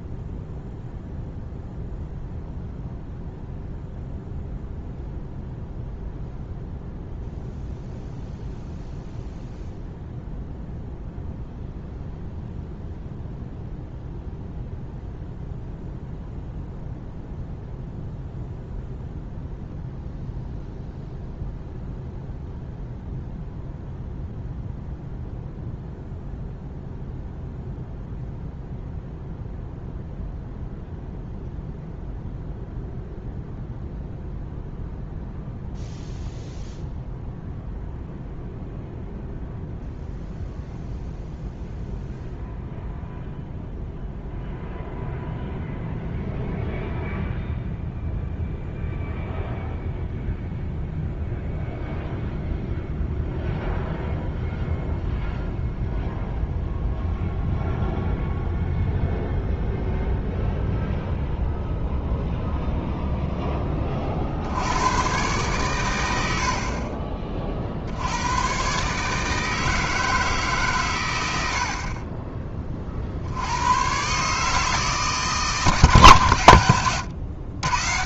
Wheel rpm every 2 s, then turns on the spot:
0, 0, 0, 0, 0, 0, 0, 0, 0, 0, 0, 0, 0, 0, 0, 0, 0, 0, 0, 0, 0, 0, 0, 0, 0, 0, 0, 0, 0, 0, 0, 0, 100, 40, 140, 120, 30, 150, 100.
none